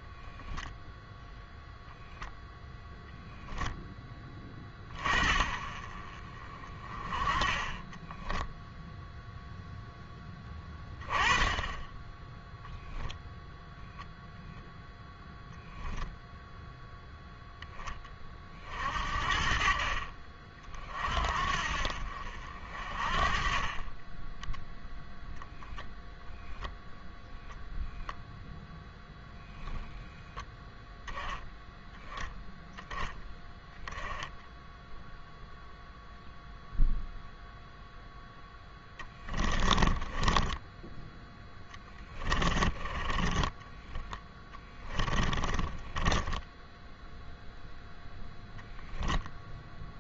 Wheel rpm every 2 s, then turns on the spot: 0, 0, 30, 30, 0, 20, 0, 0, 0, 40, 40, 50, 0, 10, 0, 10, 0, 10, 0, 10, 10, 20, 20, 0, 0.
38-46